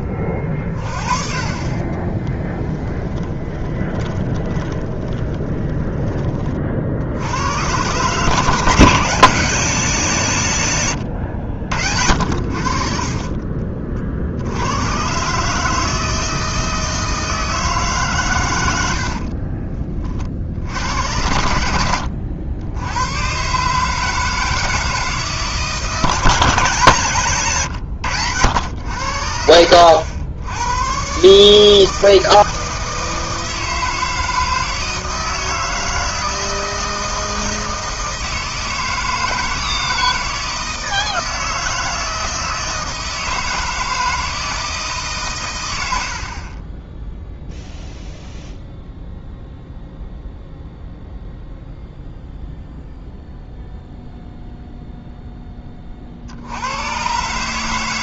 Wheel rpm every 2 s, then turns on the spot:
30, 20, 20, 40, 150, 120, 50, 110, 160, 80, 70, 90, 160, 160, 90, 120, 160, 160, 160, 160, 160, 160, 160, 10, 0, 0, 0, 0, 100.
2-6